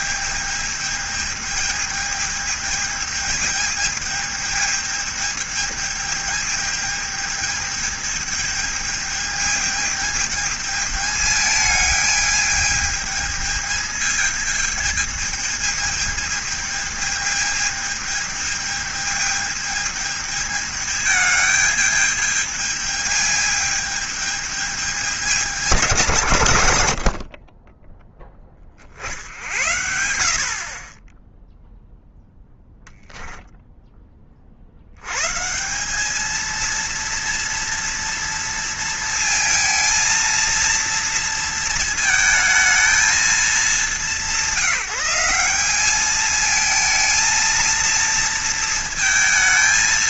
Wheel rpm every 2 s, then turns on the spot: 210, 210, 210, 220, 220, 210, 220, 220, 220, 220, 210, 210, 210, 100, 40, 40, 0, 70, 230, 230, 230, 220, 180, 220, 230.
none